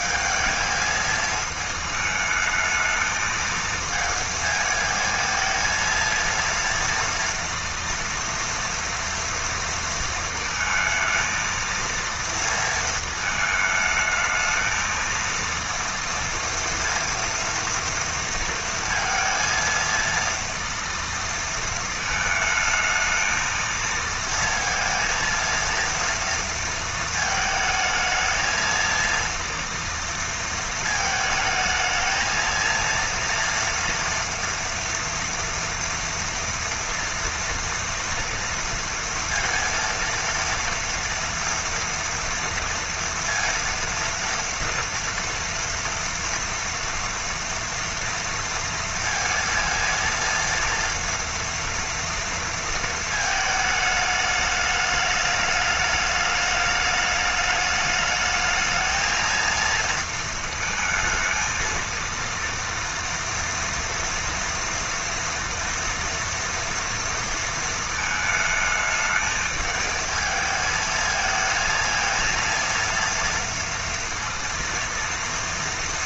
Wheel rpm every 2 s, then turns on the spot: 220, 220, 220, 230, 230, 230, 230, 220, 230, 230, 230, 220, 230, 230, 220, 230, 230, 240, 230, 230, 230, 230, 230, 230, 230, 230, 230, 210, 210, 220, 220, 230, 240, 230, 220, 220, 230, 230.
none